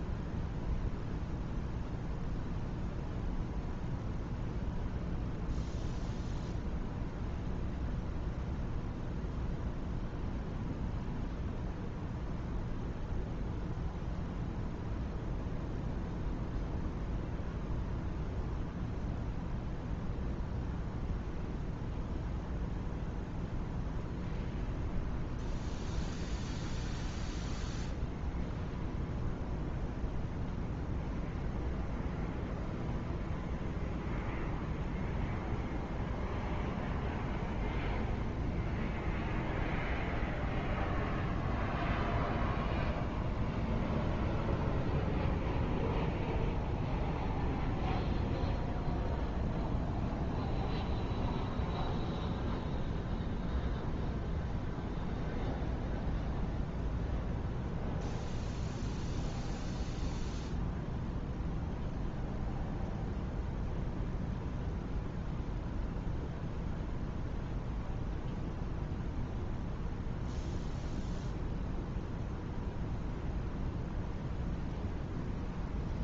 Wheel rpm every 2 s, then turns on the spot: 0, 0, 0, 0, 0, 0, 0, 0, 0, 0, 0, 0, 0, 0, 0, 0, 0, 0, 0, 0, 0, 0, 0, 0, 0, 0, 0, 0, 0, 0, 0, 0, 0, 0, 0, 0, 0, 0.
none